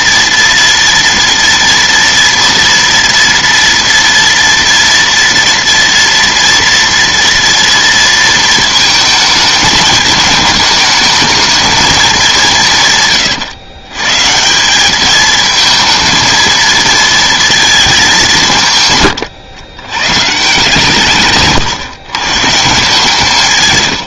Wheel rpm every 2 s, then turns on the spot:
230, 230, 230, 240, 230, 220, 180, 180, 230, 160, 160, 160.
none